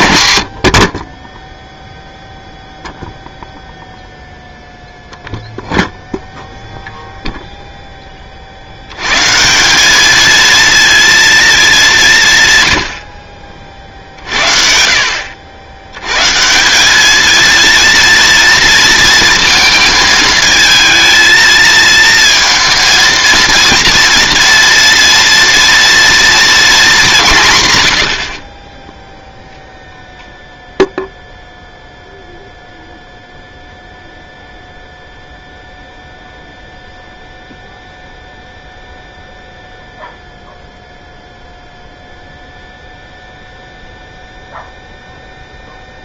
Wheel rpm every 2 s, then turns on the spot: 90, 0, 0, 0, 40, 230, 110, 50, 170, 230, 220, 230, 230, 230, 20, 0, 0, 0, 0, 0, 0, 0, 0.
none